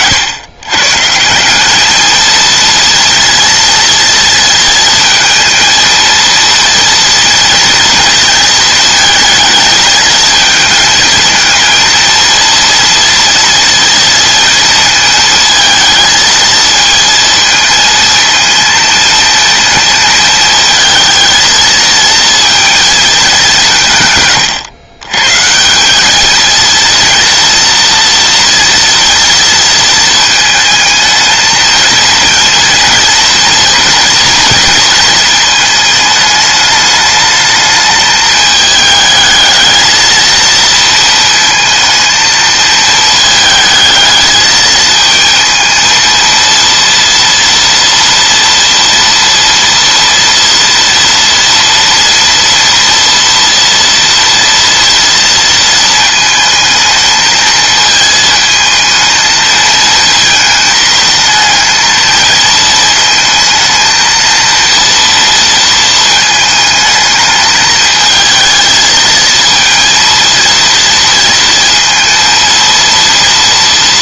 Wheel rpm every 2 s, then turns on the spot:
140, 230, 230, 230, 230, 230, 230, 230, 220, 230, 220, 230, 130, 230, 230, 220, 230, 220, 210, 220, 230, 220, 220, 230, 230, 230, 230, 230, 220, 220, 220, 230, 230, 220, 220, 230, 230.
none